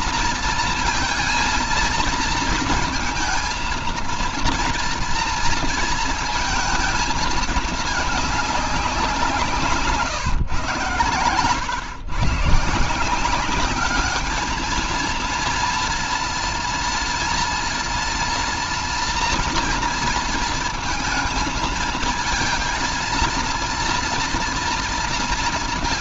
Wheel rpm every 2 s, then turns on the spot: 230, 220, 230, 220, 190, 130, 170, 220, 230, 240, 230, 230, 230.
none